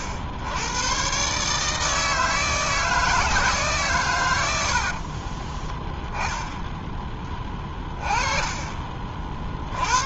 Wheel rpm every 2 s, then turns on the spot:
110, 160, 70, 10, 30.
4-6 8-10